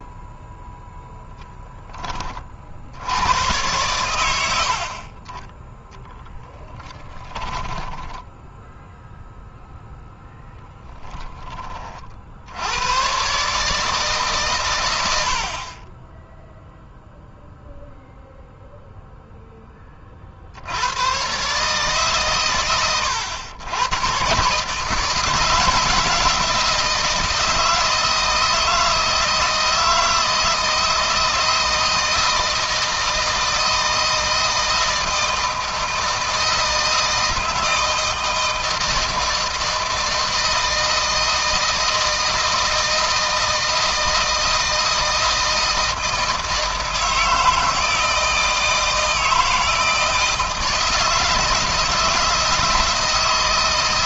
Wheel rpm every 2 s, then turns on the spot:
0, 70, 50, 10, 0, 10, 100, 110, 0, 0, 90, 110, 150, 160, 160, 160, 160, 160, 160, 160, 160, 160, 160, 160, 160, 160, 160.
6-8